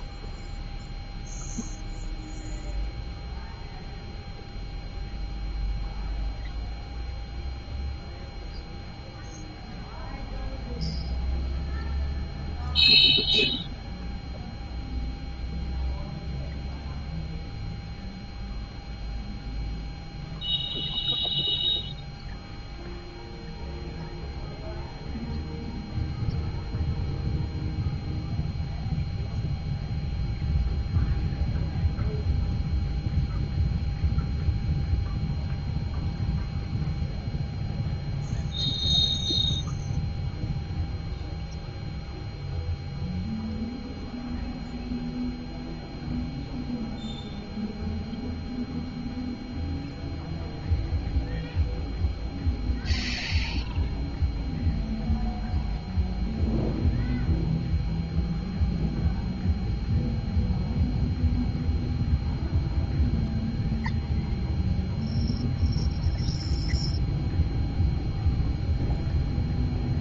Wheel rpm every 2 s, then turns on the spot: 0, 0, 0, 0, 0, 0, 0, 0, 0, 0, 0, 0, 0, 0, 0, 0, 0, 0, 0, 0, 0, 0, 0, 0, 0, 0, 0, 0, 0, 0, 0, 0, 0, 0, 0.
none